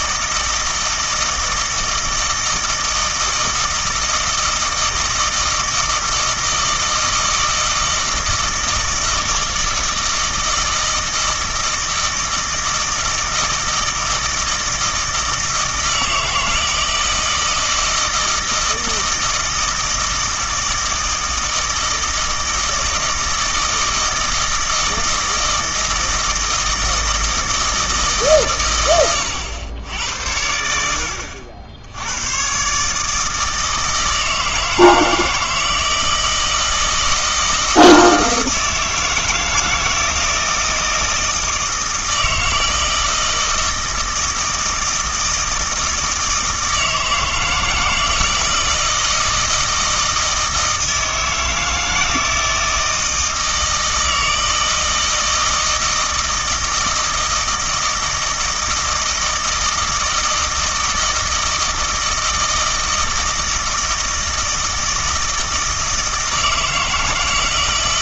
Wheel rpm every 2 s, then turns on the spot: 160, 160, 160, 160, 170, 160, 160, 160, 160, 160, 160, 160, 160, 160, 120, 70, 130, 160, 160, 160, 160, 160, 160, 160, 170, 160, 160, 160, 160, 160, 160, 160, 160, 160.
none